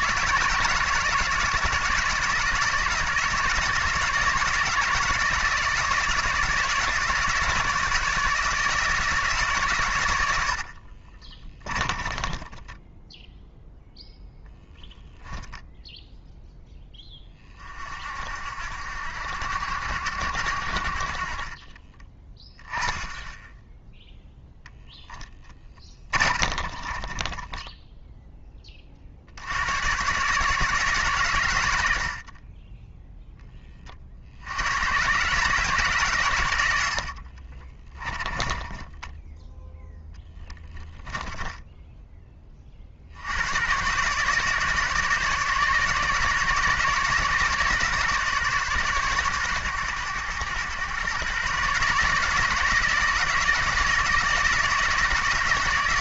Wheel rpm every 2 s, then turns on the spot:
170, 160, 160, 160, 160, 40, 10, 10, 10, 70, 50, 10, 10, 30, 40, 150, 10, 120, 80, 10, 20, 50, 150, 150, 140, 120, 160, 160.
10-14 24-28 32-34 38-42